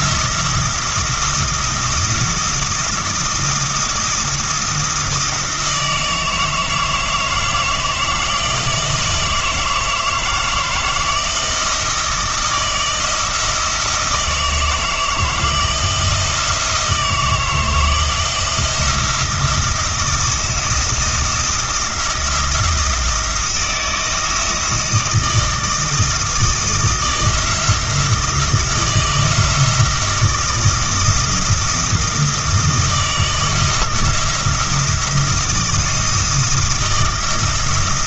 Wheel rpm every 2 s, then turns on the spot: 170, 170, 170, 160, 170, 160, 160, 160, 160, 170, 170, 170, 160, 160, 170, 160, 160, 170, 170.
none